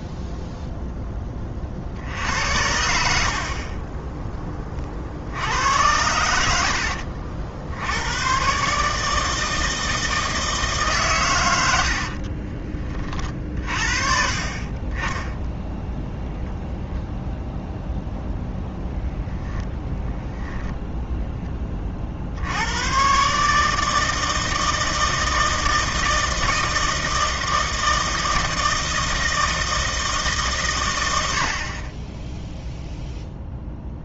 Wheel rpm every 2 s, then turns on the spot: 0, 70, 40, 70, 150, 150, 30, 30, 0, 0, 0, 100, 160, 160, 160, 110, 0.
6-8